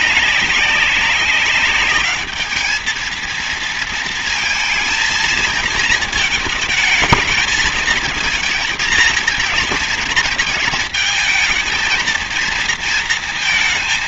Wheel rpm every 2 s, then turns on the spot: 200, 210, 230, 220, 220, 220, 230.
none